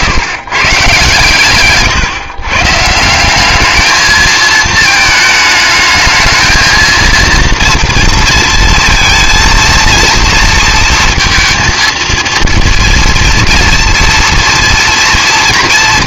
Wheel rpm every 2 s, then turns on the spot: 130, 150, 220, 220, 230, 230, 230, 230.
none